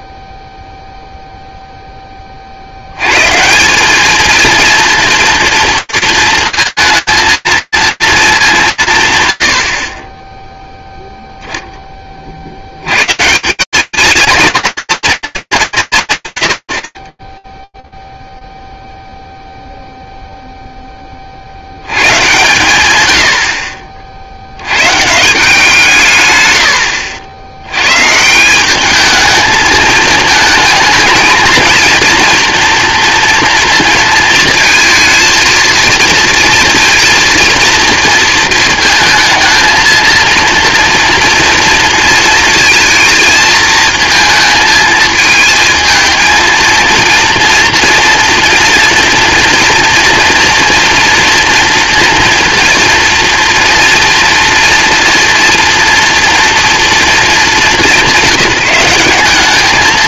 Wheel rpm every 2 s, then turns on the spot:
0, 70, 230, 220, 200, 10, 100, 230, 120, 0, 0, 130, 90, 100, 200, 220, 240, 230, 230, 220, 230, 230, 220, 230, 240, 230, 230, 230, 230, 180.
none